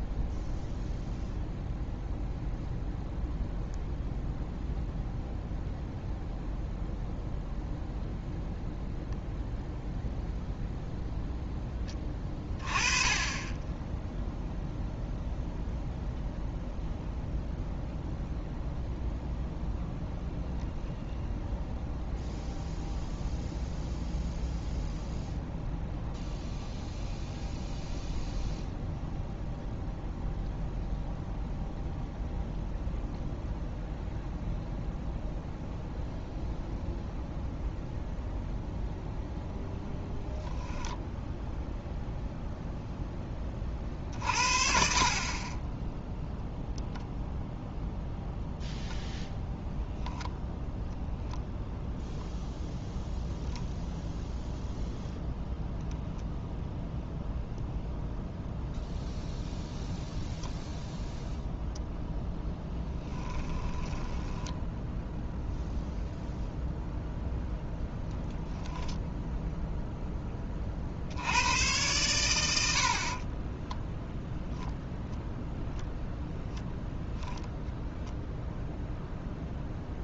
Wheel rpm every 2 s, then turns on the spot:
0, 0, 0, 0, 0, 0, 20, 0, 0, 0, 0, 0, 0, 0, 0, 0, 0, 0, 0, 0, 0, 0, 50, 0, 0, 0, 0, 0, 0, 0, 0, 0, 10, 0, 0, 20, 90, 0, 0, 0.
64-66